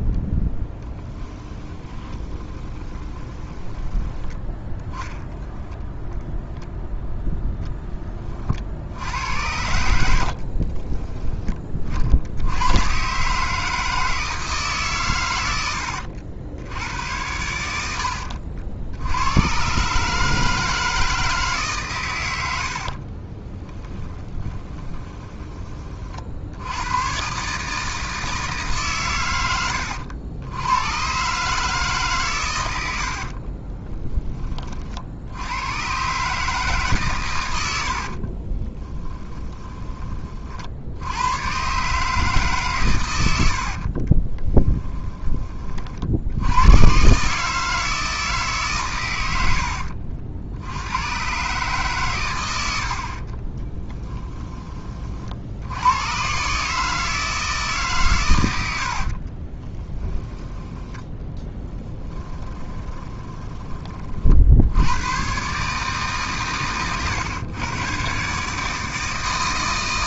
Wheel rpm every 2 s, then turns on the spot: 10, 20, 10, 0, 60, 30, 110, 150, 80, 70, 160, 70, 20, 90, 140, 100, 110, 40, 150, 20, 70, 130, 10, 90, 140, 80, 100, 20, 150, 70, 10, 10, 80, 120, 160.
0-4 10-12 22-26 38-40 44-46 62-64